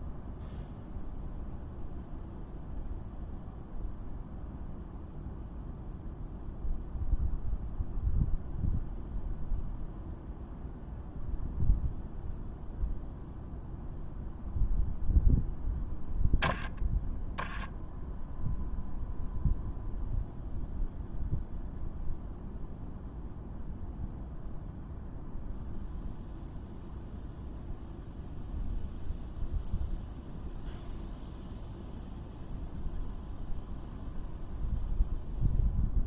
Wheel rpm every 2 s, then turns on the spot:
0, 0, 0, 0, 0, 0, 0, 0, 0, 0, 0, 0, 0, 0, 0, 0, 0, 0.
none